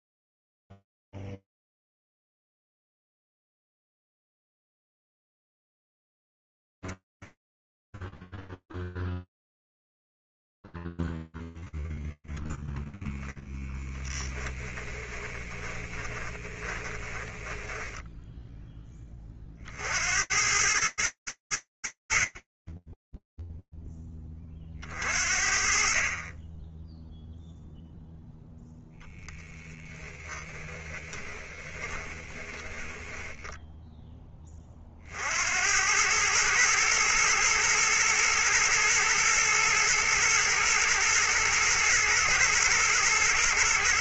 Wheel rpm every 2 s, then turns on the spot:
0, 0, 20, 0, 10, 10, 0, 10, 20, 10, 70, 70, 10, 40, 0, 20, 10, 80, 110, 110, 120, 120.
14-20 30-34